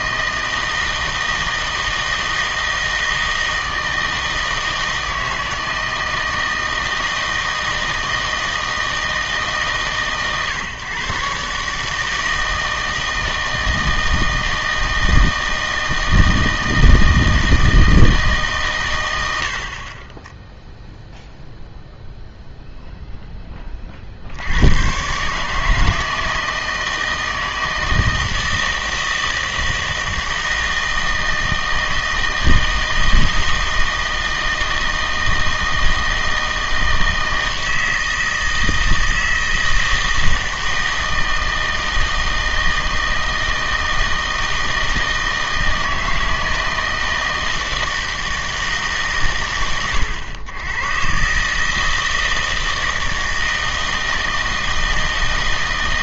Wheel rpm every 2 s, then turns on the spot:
160, 160, 160, 160, 160, 130, 160, 160, 160, 130, 0, 0, 90, 160, 160, 160, 160, 160, 160, 160, 160, 160, 160, 160, 160, 110, 160, 160.
none